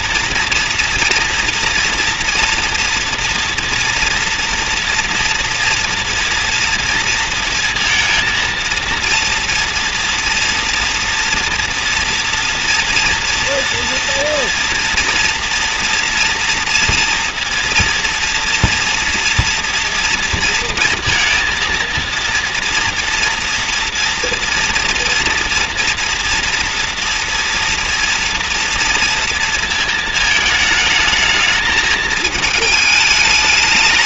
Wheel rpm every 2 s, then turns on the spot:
230, 230, 230, 230, 230, 230, 230, 230, 230, 230, 230, 230, 240, 230, 230, 220, 210.
none